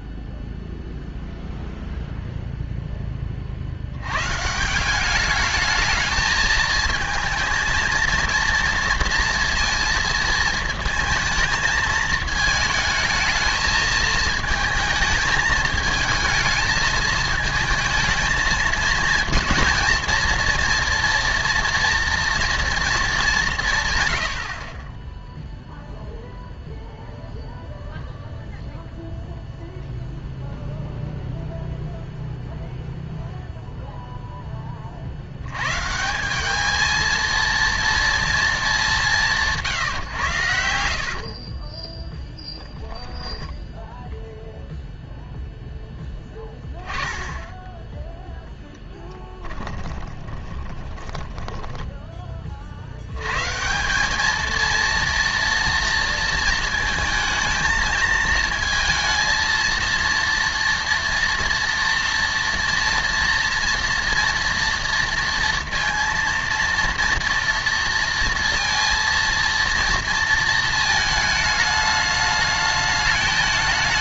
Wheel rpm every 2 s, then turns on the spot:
0, 0, 170, 220, 230, 230, 220, 220, 220, 220, 230, 230, 50, 0, 0, 0, 0, 20, 210, 210, 90, 10, 0, 10, 10, 20, 50, 230, 230, 230, 230, 230, 230, 230, 230, 220, 210.
40-44 46-52